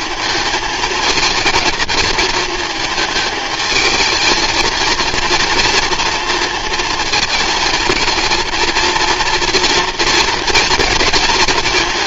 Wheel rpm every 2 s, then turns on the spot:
230, 220, 230, 230, 230, 220.
none